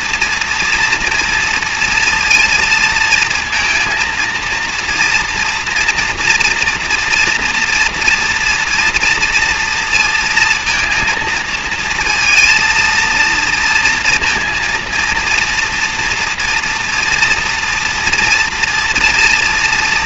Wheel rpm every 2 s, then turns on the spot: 230, 230, 230, 230, 230, 230, 230, 230, 230, 230.
none